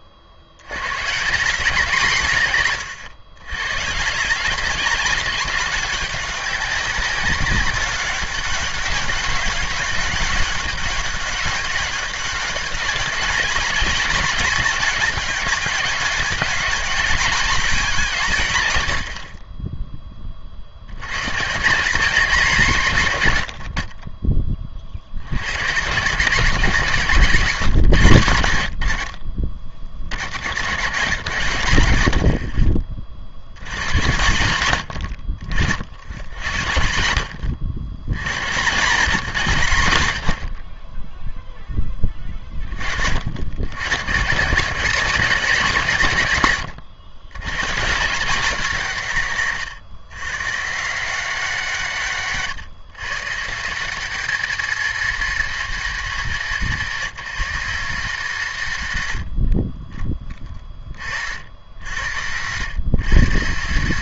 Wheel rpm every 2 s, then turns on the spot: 100, 130, 180, 200, 200, 190, 190, 210, 200, 130, 60, 170, 30, 160, 80, 80, 50, 90, 60, 110, 40, 30, 180, 110, 190, 140, 130, 190, 170, 130, 30, 110.
none